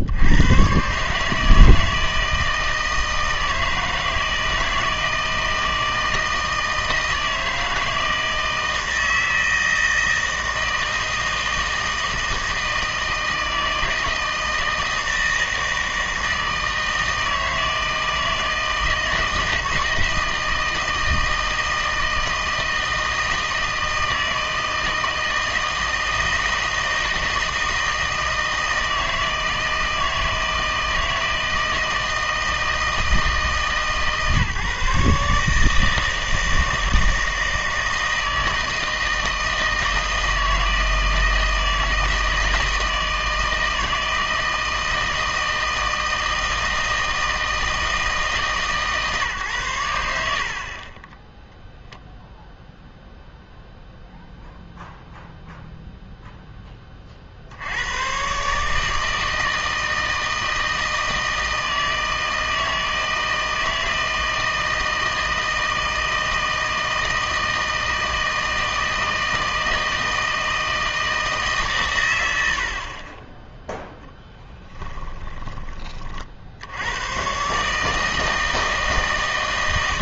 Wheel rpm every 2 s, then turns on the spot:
120, 160, 160, 160, 160, 160, 160, 160, 160, 160, 160, 160, 160, 160, 160, 160, 160, 140, 160, 160, 160, 160, 160, 160, 150, 40, 0, 0, 10, 150, 160, 160, 160, 160, 160, 160, 70, 10, 70, 160.
74-76